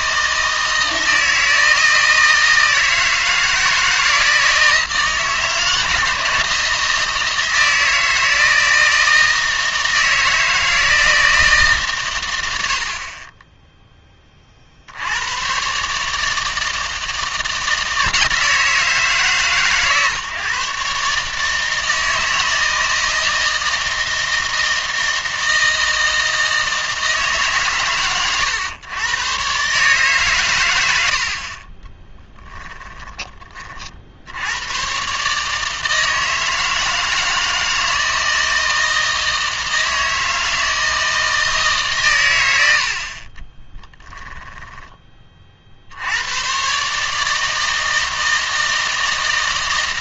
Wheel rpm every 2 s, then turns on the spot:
160, 160, 160, 160, 160, 160, 60, 50, 160, 160, 140, 160, 160, 160, 100, 90, 20, 120, 160, 160, 160, 80, 10, 130, 160.
32-34